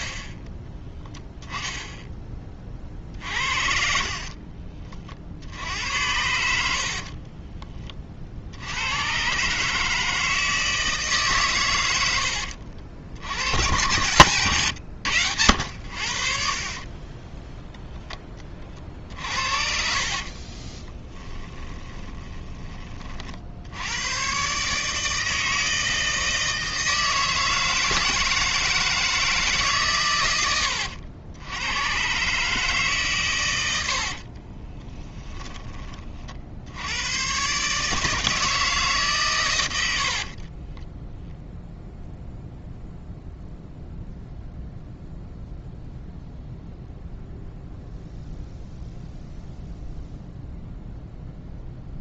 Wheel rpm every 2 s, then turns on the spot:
30, 30, 50, 60, 80, 160, 60, 120, 40, 30, 20, 20, 130, 160, 160, 90, 150, 20, 80, 150, 30, 0, 0, 0, 0, 0.
14-16 20-22 34-36 40-42